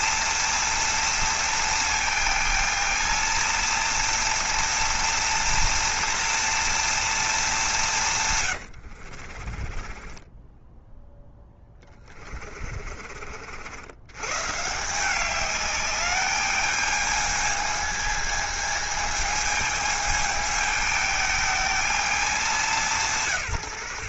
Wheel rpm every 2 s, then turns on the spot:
230, 220, 230, 230, 70, 10, 40, 160, 210, 220, 220, 170.
8-10 12-14